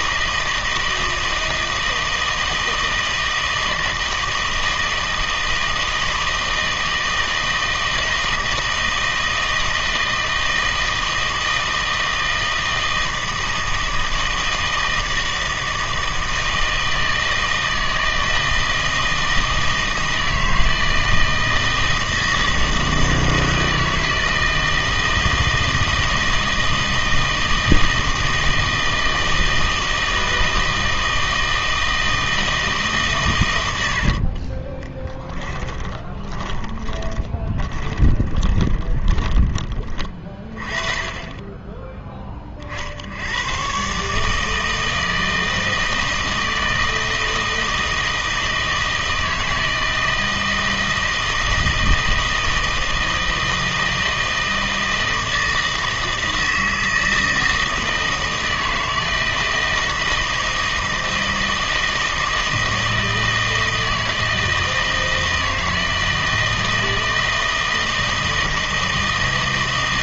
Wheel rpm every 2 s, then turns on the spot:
160, 160, 160, 160, 160, 160, 160, 160, 160, 160, 160, 160, 160, 160, 160, 160, 160, 30, 20, 20, 30, 50, 160, 160, 160, 160, 160, 160, 160, 160, 160, 160, 160, 160, 160.
34-40